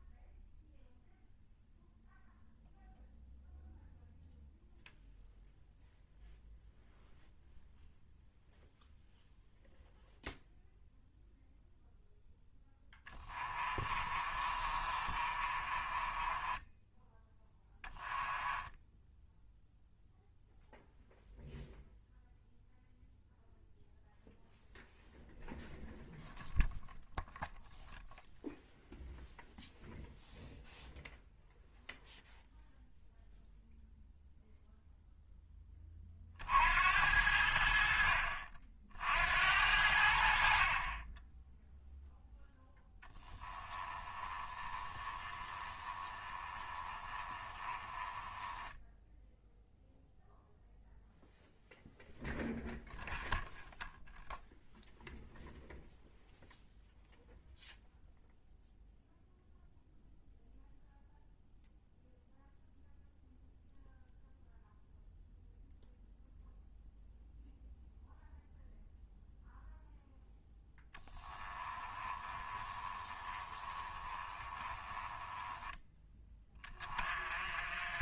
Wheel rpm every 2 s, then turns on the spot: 0, 0, 0, 0, 0, 0, 10, 40, 10, 10, 0, 0, 0, 0, 0, 0, 0, 0, 60, 60, 30, 10, 20, 20, 10, 0, 0, 0, 0, 0, 0, 0, 0, 0, 0, 10, 20, 20, 30.
12-20 44-50 70-76